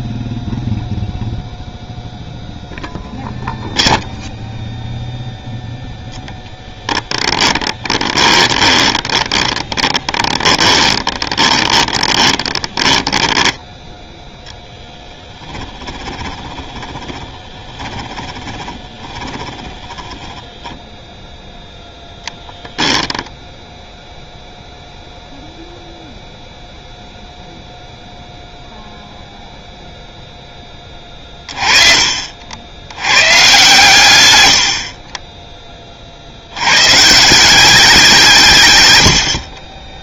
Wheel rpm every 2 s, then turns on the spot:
10, 0, 0, 10, 20, 20, 20, 10, 20, 20, 10, 10, 0, 0, 0, 20, 110, 30, 140, 90.
0-2 8-14 16-20 34-36